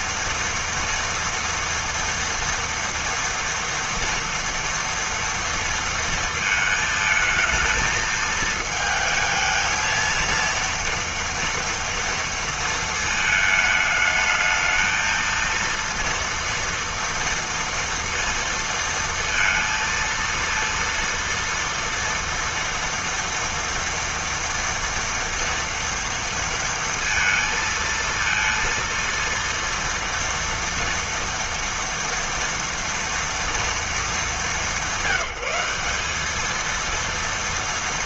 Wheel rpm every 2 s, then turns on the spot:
230, 230, 230, 220, 220, 230, 230, 220, 230, 230, 230, 230, 240, 230, 230, 230, 230, 190, 220.
none